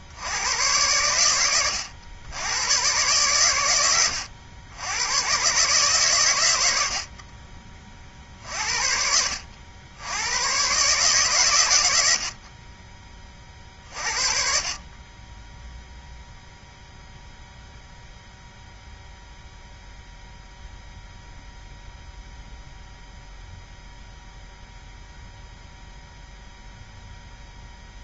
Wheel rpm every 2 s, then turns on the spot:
80, 90, 90, 120, 50, 100, 60, 40, 0, 0, 0, 0, 0, 0.
none